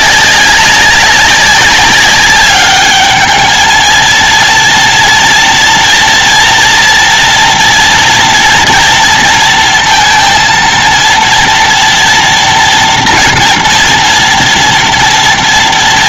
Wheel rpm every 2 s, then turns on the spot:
200, 200, 230, 240, 230, 230, 230, 230.
none